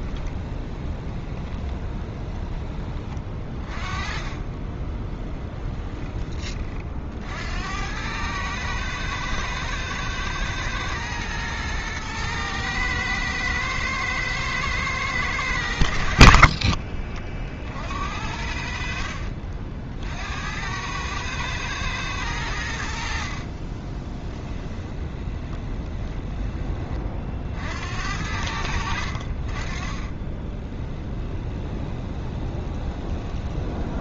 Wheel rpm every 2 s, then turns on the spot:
20, 20, 20, 30, 110, 110, 110, 110, 50, 60, 90, 90, 10, 20, 80, 10, 20.
0-2 4-6 16-18 24-26 30-34